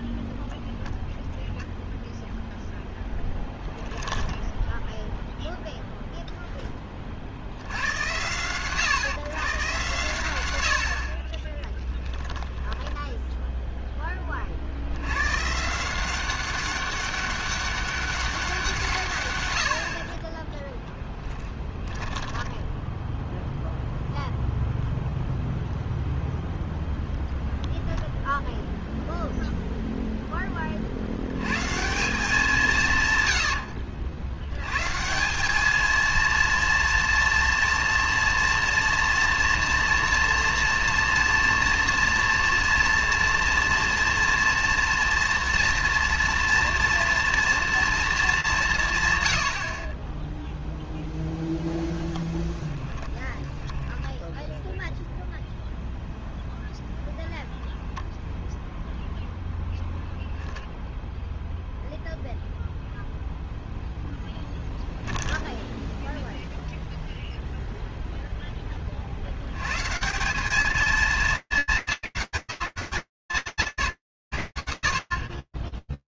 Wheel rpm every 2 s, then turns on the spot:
0, 0, 0, 50, 120, 50, 10, 110, 200, 130, 10, 10, 0, 0, 0, 50, 140, 170, 230, 230, 230, 230, 240, 230, 130, 0, 10, 0, 10, 0, 0, 0, 0, 0, 90, 220, 140, 110.
10-14 20-24 52-54